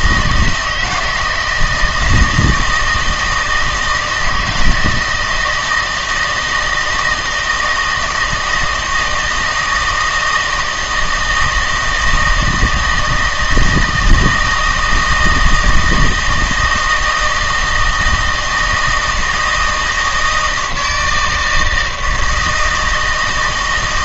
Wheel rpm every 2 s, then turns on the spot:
170, 160, 160, 160, 160, 160, 160, 160, 160, 160, 160, 160.
none